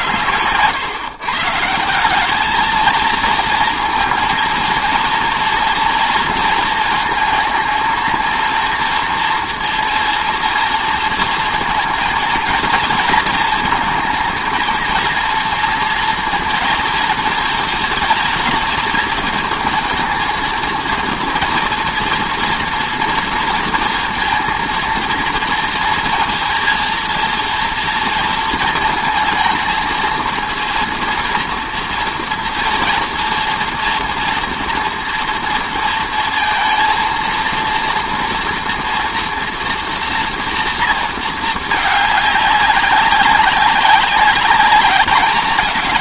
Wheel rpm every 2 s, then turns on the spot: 110, 220, 230, 230, 230, 230, 230, 230, 230, 220, 220, 230, 230, 230, 230, 230, 230, 230, 230, 230, 230, 200, 200.
none